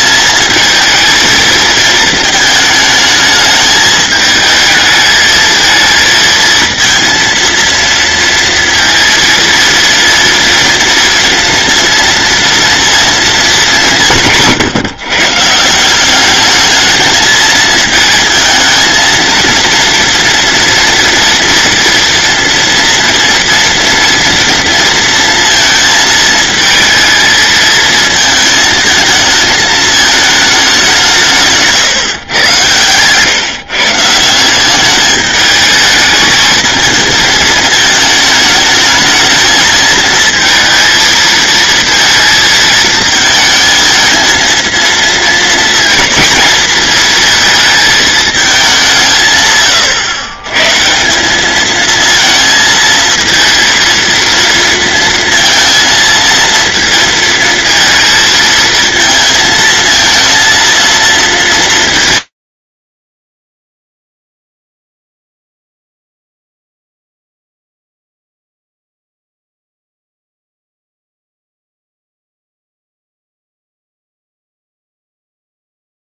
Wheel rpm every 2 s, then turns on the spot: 220, 220, 220, 230, 230, 230, 230, 150, 210, 220, 230, 230, 230, 220, 220, 200, 110, 200, 220, 220, 230, 220, 230, 220, 180, 150, 220, 230, 230, 220, 230, 90, 0, 0, 0, 0, 0, 0.
none